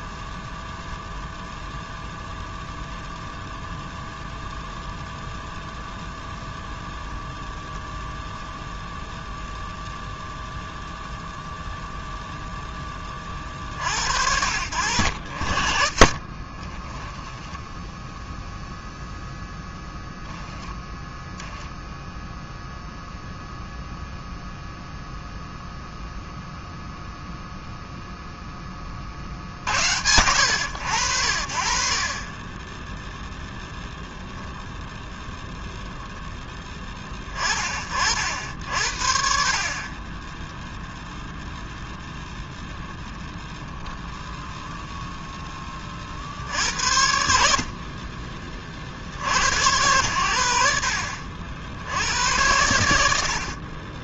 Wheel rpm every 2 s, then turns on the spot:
0, 0, 0, 0, 0, 0, 10, 70, 10, 0, 0, 0, 0, 0, 30, 90, 10, 0, 20, 60, 0, 0, 0, 70, 50, 80, 100.
16-18